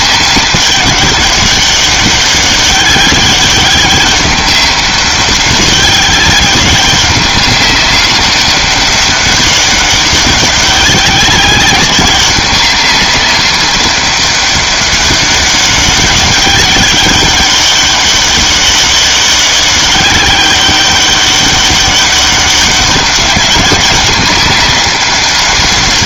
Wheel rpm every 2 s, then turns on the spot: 190, 200, 200, 200, 200, 190, 190, 200, 200, 200, 200, 200, 200.
none